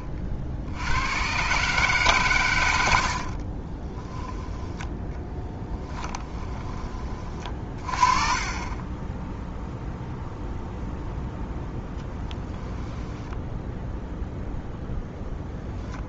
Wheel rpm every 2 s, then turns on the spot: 70, 80, 10, 30, 20, 0, 10, 0.
4-6 12-14